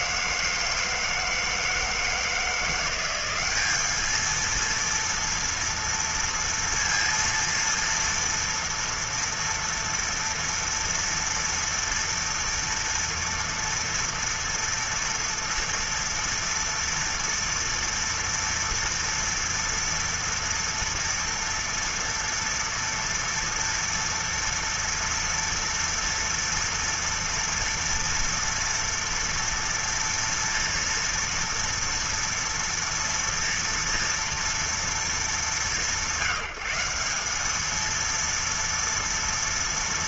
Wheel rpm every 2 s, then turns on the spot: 170, 170, 220, 230, 230, 230, 230, 230, 230, 230, 230, 230, 230, 230, 230, 230, 230, 230, 170, 230.
none